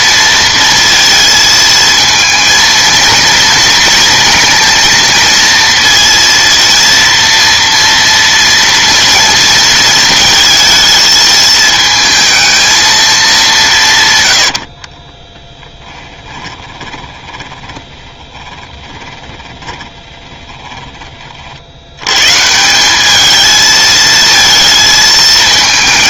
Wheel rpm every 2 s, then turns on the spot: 230, 230, 230, 230, 230, 220, 220, 70, 20, 10, 10, 160, 230.
14-20